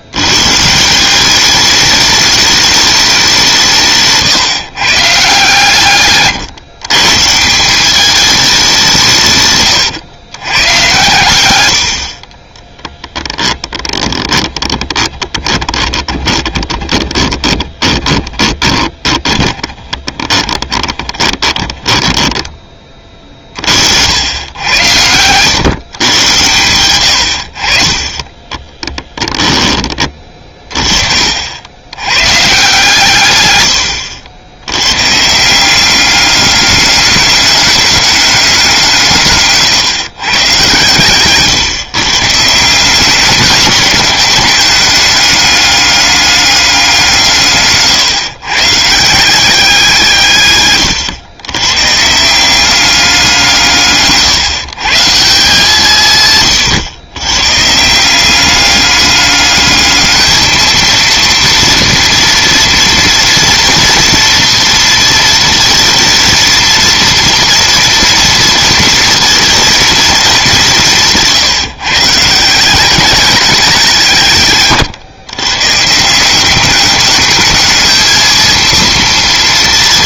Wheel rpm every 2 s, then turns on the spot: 130, 210, 140, 130, 200, 110, 20, 10, 20, 20, 30, 30, 100, 90, 30, 30, 130, 90, 200, 180, 130, 170, 210, 200, 140, 130, 190, 150, 140, 200, 220, 240, 230, 230, 230, 200, 170, 140, 200, 230.
12-22 28-32